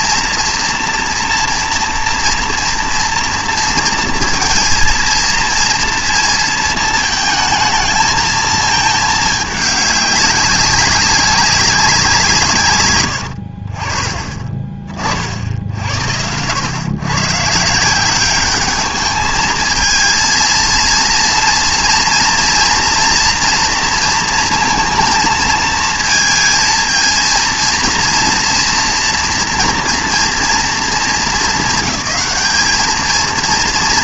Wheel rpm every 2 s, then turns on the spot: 230, 230, 230, 220, 220, 200, 150, 20, 90, 200, 230, 240, 230, 230, 240, 230, 200.
none